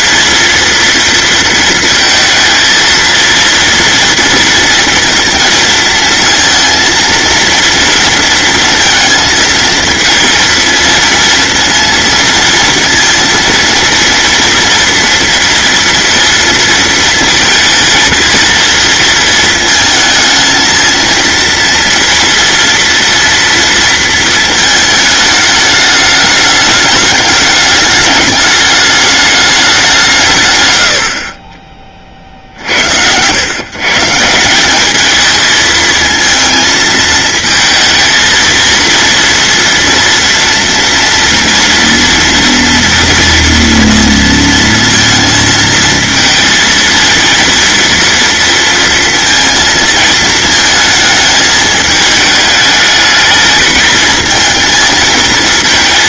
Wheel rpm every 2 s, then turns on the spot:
230, 230, 230, 230, 230, 230, 230, 230, 230, 230, 220, 230, 220, 210, 210, 120, 70, 180, 230, 230, 230, 230, 230, 220, 230, 220, 210, 220.
none